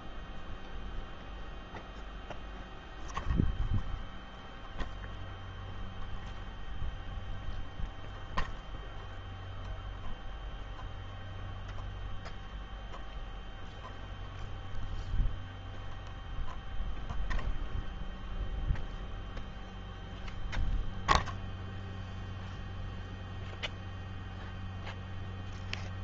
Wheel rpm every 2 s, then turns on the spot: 0, 0, 0, 0, 0, 0, 0, 0, 0, 0, 0, 0, 0.
none